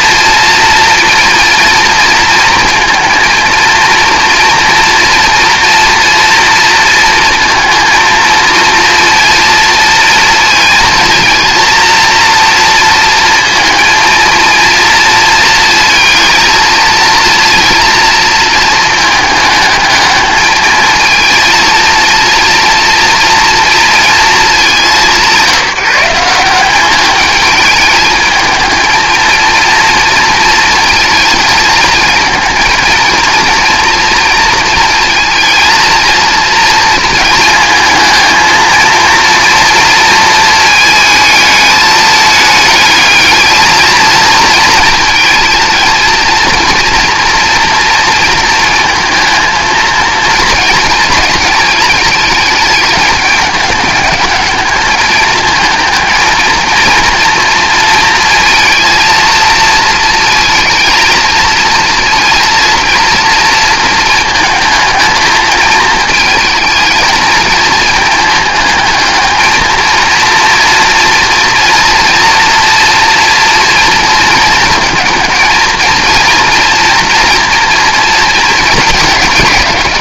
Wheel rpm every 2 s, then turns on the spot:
230, 230, 230, 230, 230, 230, 230, 230, 230, 220, 220, 230, 190, 200, 220, 230, 220, 230, 230, 230, 220, 210, 230, 230, 230, 230, 210, 210, 230, 230, 230, 230, 220, 220, 220, 230, 240, 230, 240, 220.
none